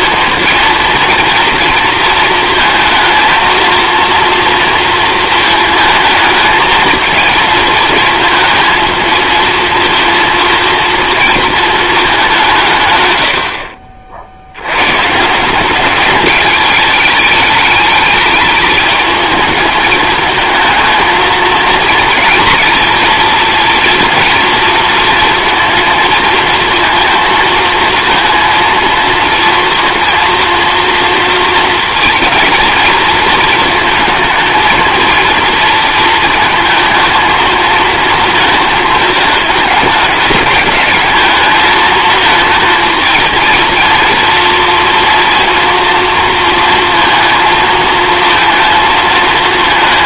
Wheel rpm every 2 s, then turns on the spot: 230, 230, 230, 220, 220, 230, 140, 100, 210, 210, 220, 230, 230, 230, 230, 230, 230, 230, 220, 220, 210, 220, 230, 230, 230.
none